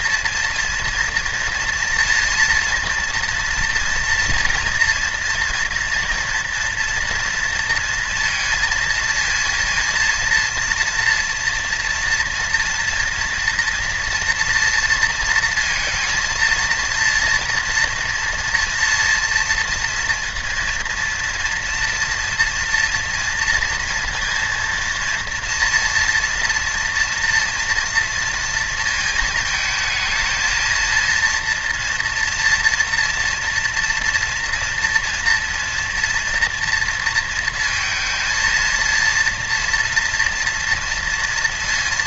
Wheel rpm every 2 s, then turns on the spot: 240, 230, 230, 230, 230, 240, 230, 230, 230, 230, 230, 230, 240, 230, 230, 230, 230, 230, 230, 230, 230.
none